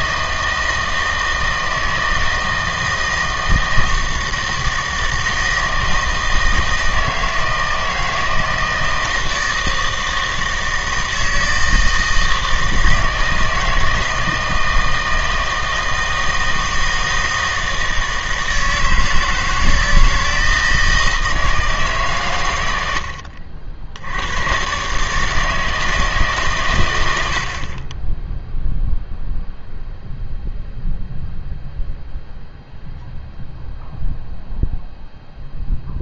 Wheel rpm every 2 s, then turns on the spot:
160, 160, 160, 160, 160, 160, 160, 160, 160, 160, 160, 100, 120, 130, 0, 0, 0, 0.
none